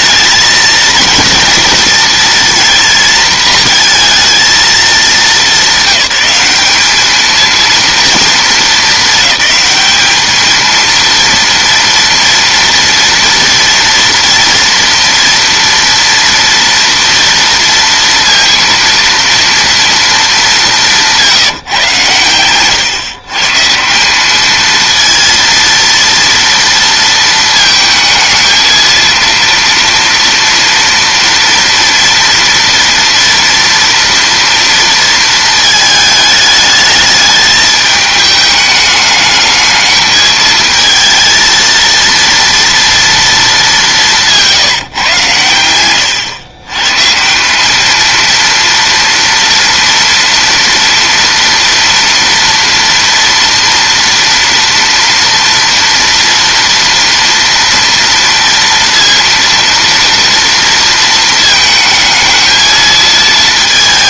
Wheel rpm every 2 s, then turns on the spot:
220, 230, 220, 200, 220, 220, 230, 230, 230, 230, 190, 120, 220, 230, 220, 230, 230, 230, 210, 210, 220, 230, 170, 120, 230, 230, 230, 230, 230, 230, 230, 220.
none